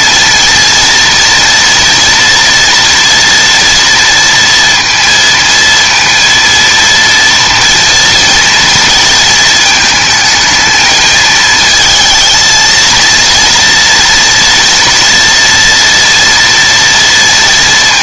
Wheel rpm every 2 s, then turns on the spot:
240, 240, 230, 230, 230, 220, 230, 230, 230.
none